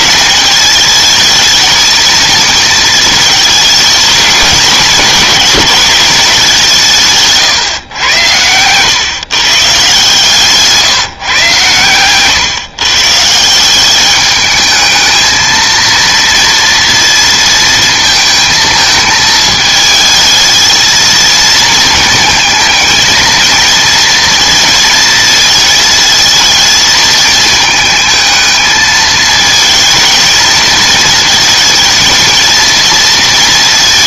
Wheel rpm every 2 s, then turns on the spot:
220, 220, 210, 180, 110, 150, 140, 210, 230, 220, 220, 220, 230, 220, 220, 220, 230.
none